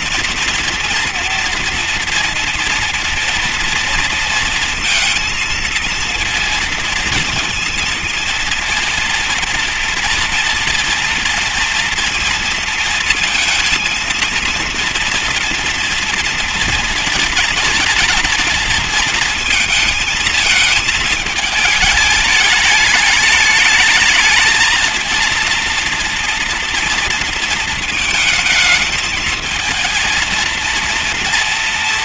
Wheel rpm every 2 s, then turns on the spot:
230, 230, 230, 230, 230, 230, 230, 230, 230, 220, 210, 210, 230, 230, 220, 230.
none